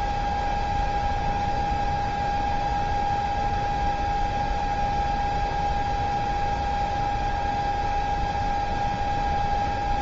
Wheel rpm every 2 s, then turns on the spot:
0, 0, 0, 0, 0.
none